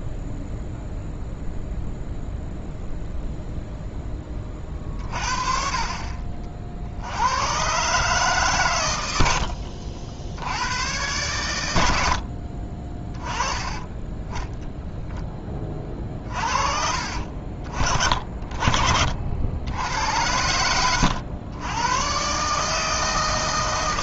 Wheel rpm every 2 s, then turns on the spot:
0, 0, 40, 60, 120, 80, 40, 10, 40, 40, 90, 150.
18-20